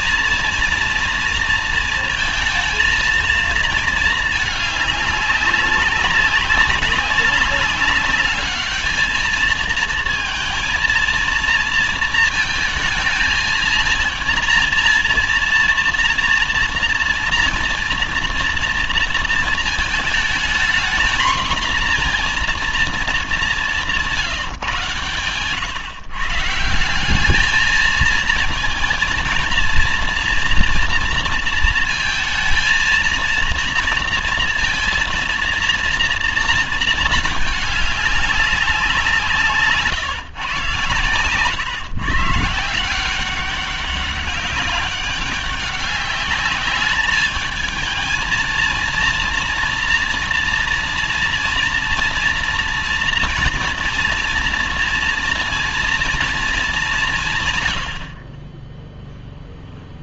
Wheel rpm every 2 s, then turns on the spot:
230, 230, 220, 190, 210, 230, 230, 230, 230, 230, 220, 240, 140, 150, 220, 230, 230, 230, 230, 190, 140, 160, 190, 210, 230, 230, 230, 240, 210, 20.
none